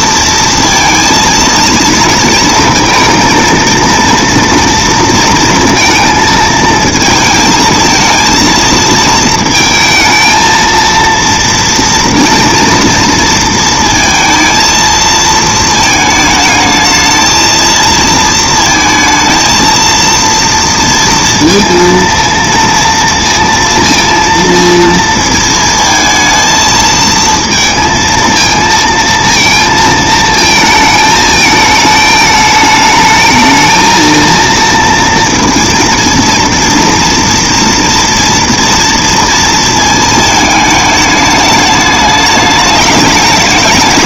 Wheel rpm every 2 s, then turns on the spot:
230, 230, 230, 230, 230, 230, 230, 220, 230, 230, 230, 230, 220, 230, 220, 220, 230, 240, 230, 220, 210, 210.
none